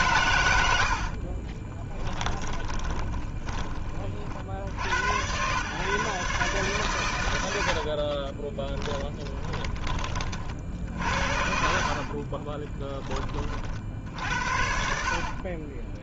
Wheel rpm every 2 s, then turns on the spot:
50, 20, 80, 130, 10, 60, 20, 60.
0-4 8-10 14-16